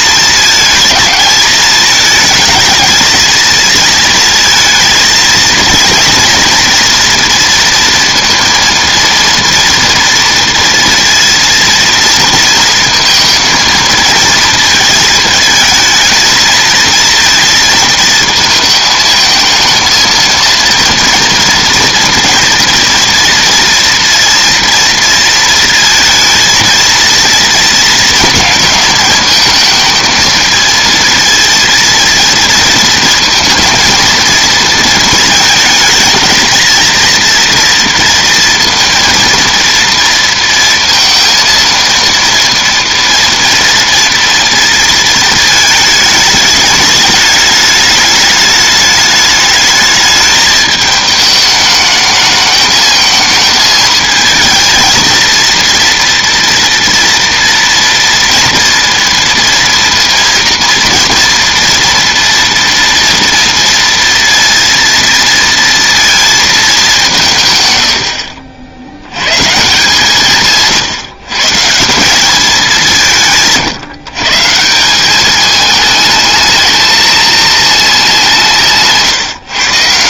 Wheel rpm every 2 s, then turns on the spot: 220, 220, 230, 230, 230, 230, 230, 230, 230, 220, 230, 230, 230, 230, 220, 220, 230, 230, 230, 230, 230, 230, 230, 210, 210, 210, 220, 220, 230, 230, 230, 230, 230, 210, 60, 140, 190, 160, 220, 160.
none